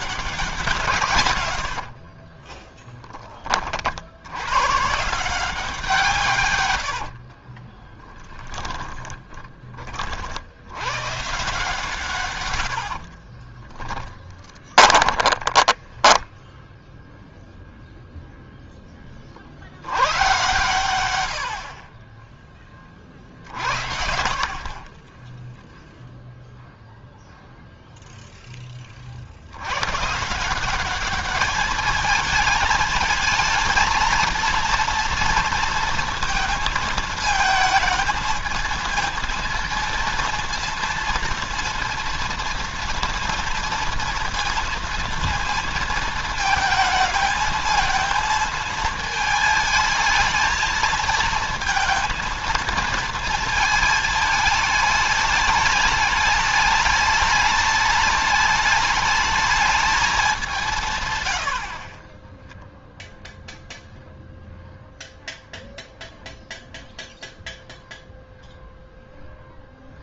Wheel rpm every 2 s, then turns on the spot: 110, 10, 160, 50, 20, 130, 50, 20, 0, 10, 100, 30, 40, 0, 20, 170, 220, 230, 230, 220, 230, 230, 230, 220, 220, 220, 230, 220, 210, 210, 210, 20, 0, 0, 0.
0-2 6-10 12-16 24-26